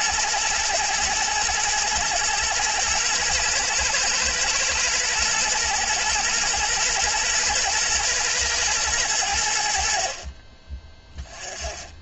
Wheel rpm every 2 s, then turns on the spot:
120, 110, 120, 120, 110, 20.
none